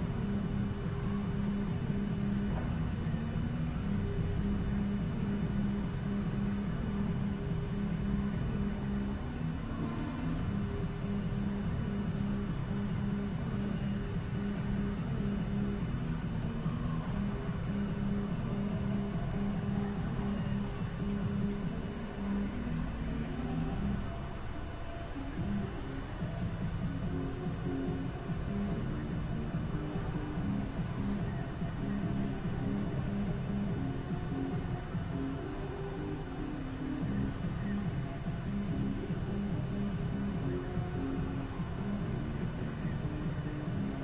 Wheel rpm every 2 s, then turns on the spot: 0, 0, 0, 0, 0, 0, 0, 0, 0, 0, 0, 0, 0, 0, 0, 0, 0, 0, 0, 0, 0, 0.
none